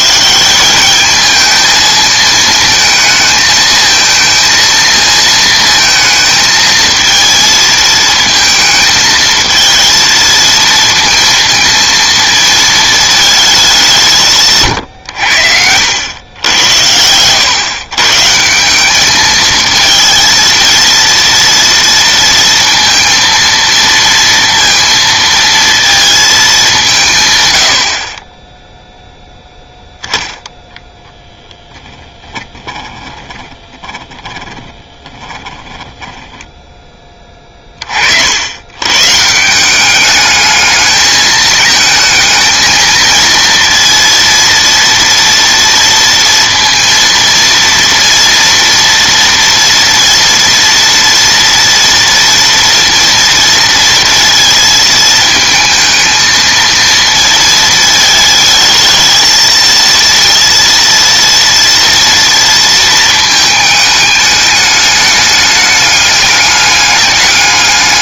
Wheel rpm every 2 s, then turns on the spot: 190, 220, 230, 230, 220, 230, 220, 120, 100, 180, 230, 230, 230, 200, 10, 0, 10, 20, 10, 110, 220, 220, 230, 230, 230, 230, 230, 220, 230, 220, 230, 230, 210, 200.
32-36